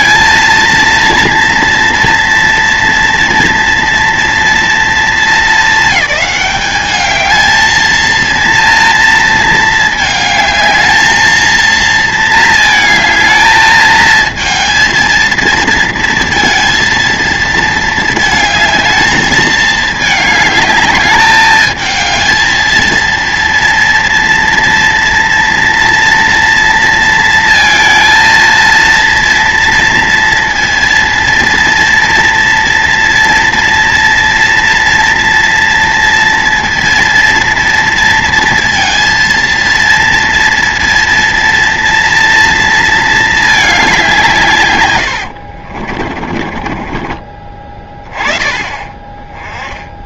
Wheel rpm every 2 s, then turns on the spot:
230, 230, 230, 200, 220, 220, 230, 220, 230, 220, 210, 210, 230, 230, 230, 230, 230, 230, 230, 230, 230, 230, 210, 50, 20.
46-48